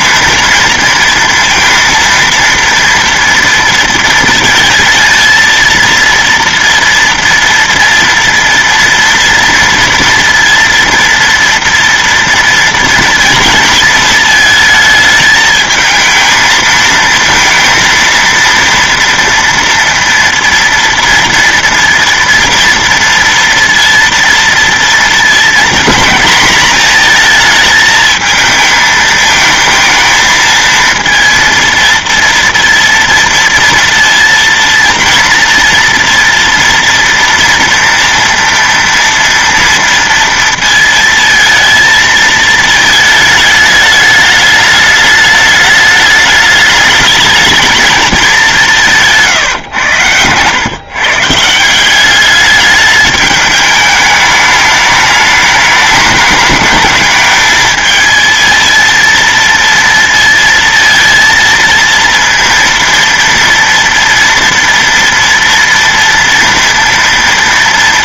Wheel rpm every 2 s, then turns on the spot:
230, 230, 230, 230, 230, 230, 230, 220, 230, 230, 230, 230, 230, 230, 220, 230, 230, 230, 230, 230, 230, 220, 210, 210, 200, 120, 200, 210, 210, 230, 230, 230, 230, 230.
none